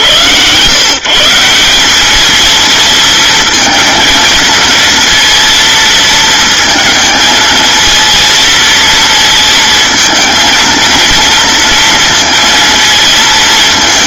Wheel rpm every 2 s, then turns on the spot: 160, 220, 230, 220, 220, 230, 220.
none